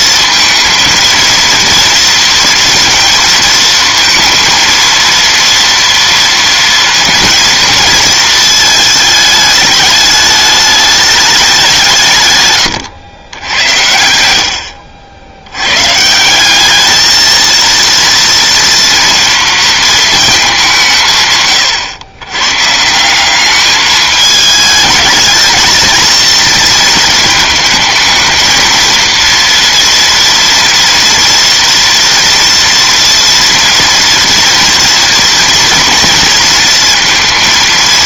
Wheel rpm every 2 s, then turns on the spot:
230, 230, 230, 230, 220, 210, 110, 70, 210, 230, 180, 150, 210, 230, 230, 230, 230, 230, 230.
none